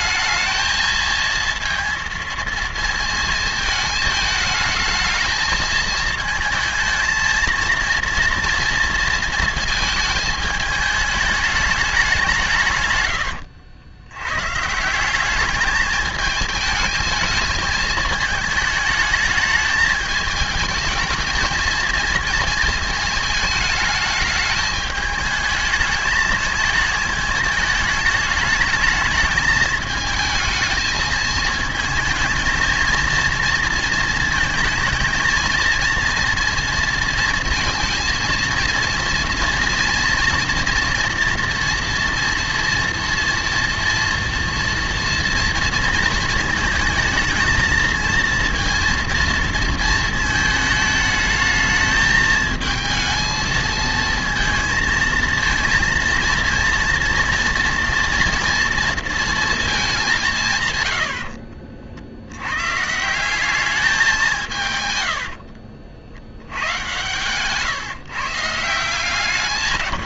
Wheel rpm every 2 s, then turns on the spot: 220, 230, 220, 230, 230, 220, 110, 180, 220, 220, 220, 220, 220, 220, 210, 220, 230, 230, 230, 230, 230, 230, 230, 230, 230, 220, 220, 230, 230, 230, 110, 140, 120, 130, 160.
none